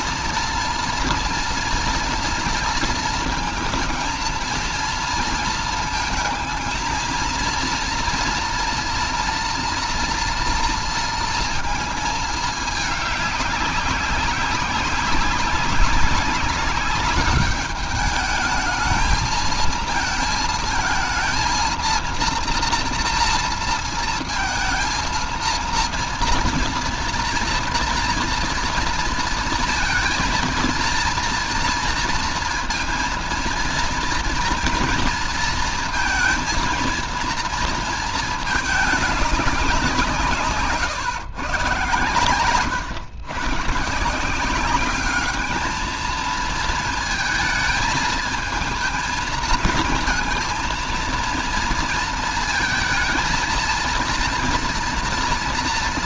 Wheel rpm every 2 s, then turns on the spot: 230, 230, 230, 220, 230, 230, 220, 200, 200, 220, 220, 230, 230, 230, 230, 230, 230, 230, 230, 220, 150, 120, 180, 230, 220, 220, 220, 240.
none